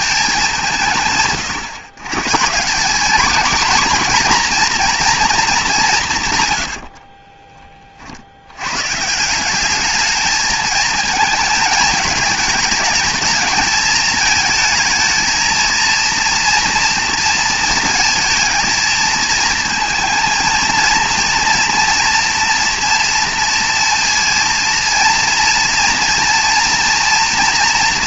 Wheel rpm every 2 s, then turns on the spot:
180, 170, 240, 100, 110, 220, 220, 220, 230, 220, 230, 230, 230, 230.
6-8